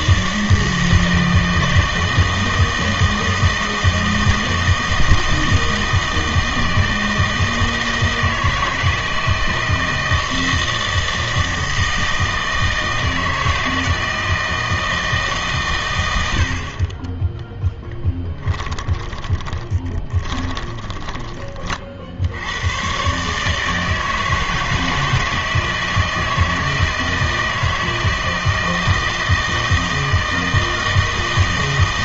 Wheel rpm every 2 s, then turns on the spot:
160, 160, 160, 160, 160, 160, 160, 160, 60, 10, 20, 100, 160, 160, 160, 160.
18-22